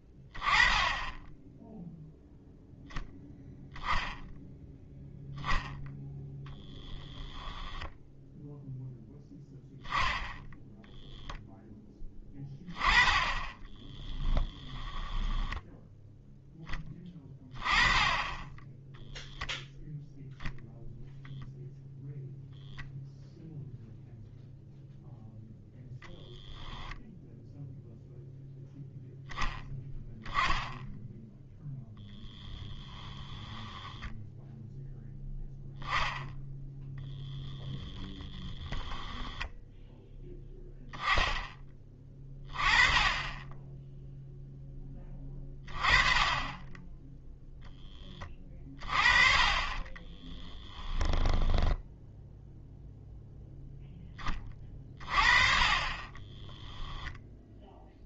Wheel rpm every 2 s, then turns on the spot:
20, 0, 0, 0, 0, 0, 20, 20, 10, 10, 10, 0, 0, 0, 0, 10, 10, 0, 10, 10, 0, 20, 20, 10, 30, 10, 0, 30, 10.
14-16 38-40 50-52